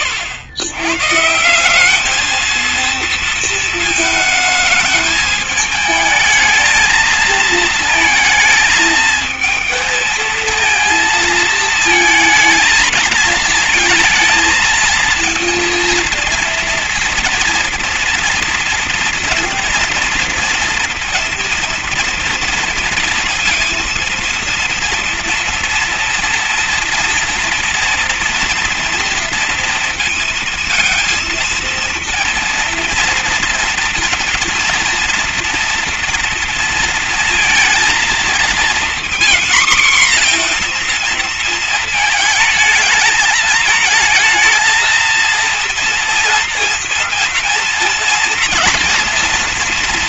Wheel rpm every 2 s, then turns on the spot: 130, 230, 220, 220, 230, 230, 220, 220, 230, 230, 230, 230, 230, 230, 240, 230, 230, 230, 230, 240, 240, 220, 230, 230, 230.
none